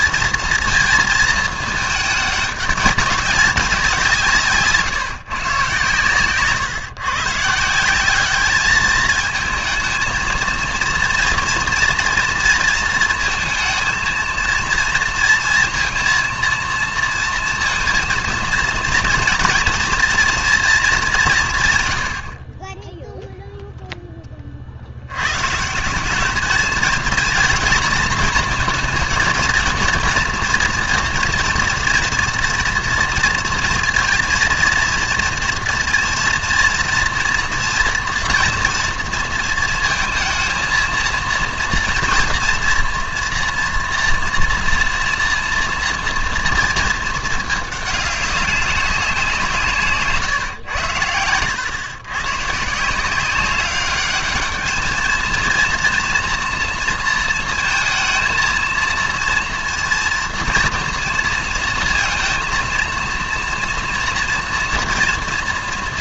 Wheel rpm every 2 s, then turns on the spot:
230, 200, 150, 130, 210, 230, 230, 230, 230, 230, 230, 40, 40, 220, 220, 230, 230, 230, 230, 230, 230, 230, 230, 230, 200, 110, 140, 220, 230, 230, 240, 230, 230.
none